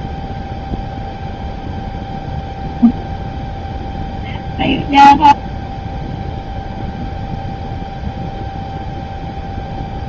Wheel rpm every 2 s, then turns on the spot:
0, 0, 0, 0, 0.
none